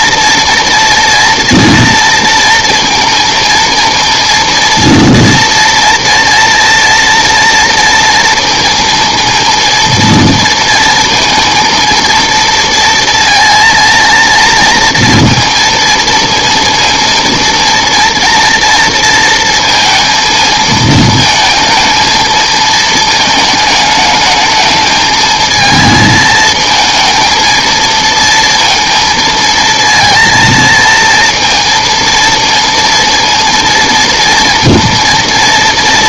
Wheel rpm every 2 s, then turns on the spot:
230, 230, 230, 240, 230, 230, 230, 230, 230, 230, 220, 220, 220, 220, 230, 230, 230, 230.
none